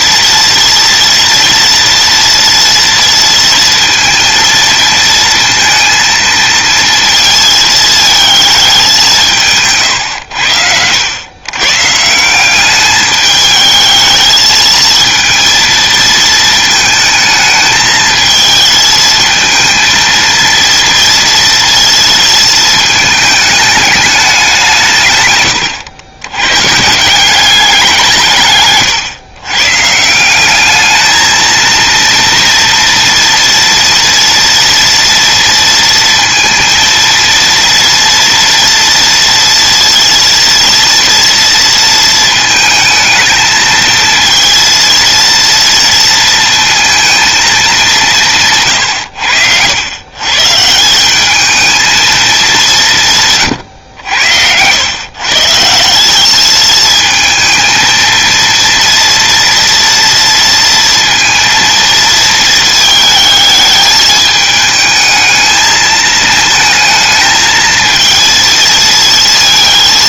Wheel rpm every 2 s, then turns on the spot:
230, 230, 230, 230, 180, 90, 200, 220, 220, 220, 230, 220, 140, 150, 130, 210, 240, 230, 230, 230, 230, 220, 230, 230, 120, 180, 160, 110, 220, 230, 230, 220, 220, 220, 230.
none